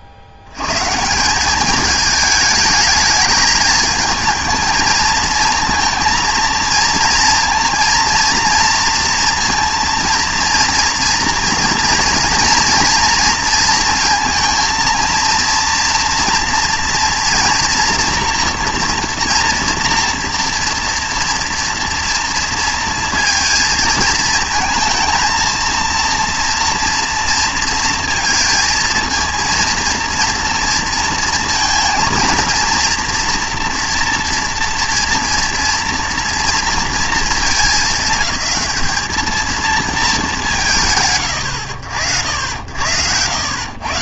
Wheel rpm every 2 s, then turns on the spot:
80, 210, 220, 230, 230, 230, 230, 230, 230, 230, 230, 230, 220, 240, 230, 230, 230, 230, 230, 200, 170, 80.
none